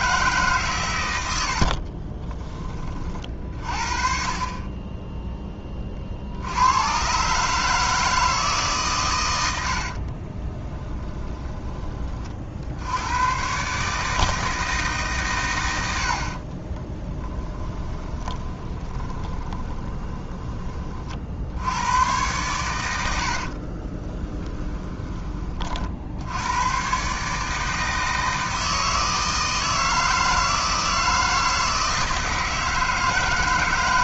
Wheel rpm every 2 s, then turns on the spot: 140, 30, 20, 90, 150, 20, 60, 160, 40, 20, 20, 100, 10, 100, 160, 160, 160.
10-12 16-20 24-26